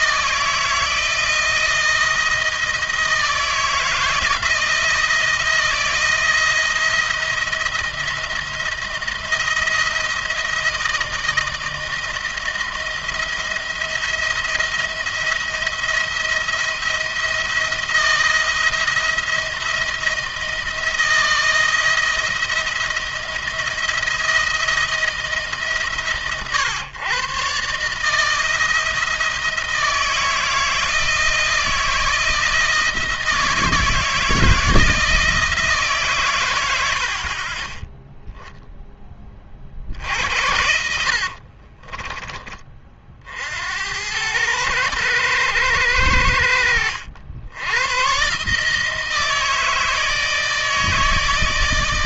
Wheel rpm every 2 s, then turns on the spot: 160, 160, 160, 170, 170, 160, 170, 170, 170, 170, 160, 160, 160, 120, 160, 160, 160, 160, 80, 10, 70, 40, 110, 80, 150, 160.
40-42